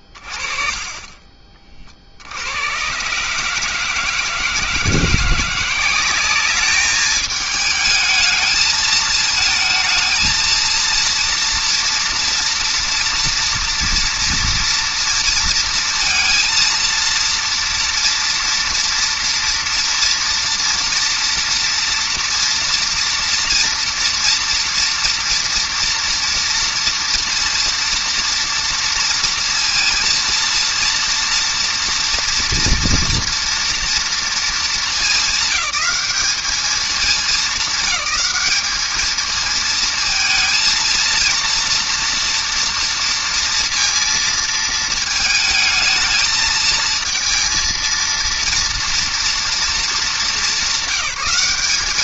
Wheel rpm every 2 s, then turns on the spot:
20, 80, 160, 200, 220, 220, 230, 230, 230, 230, 230, 230, 230, 230, 230, 230, 230, 230, 210, 210, 220, 240, 230, 220, 230, 200.
none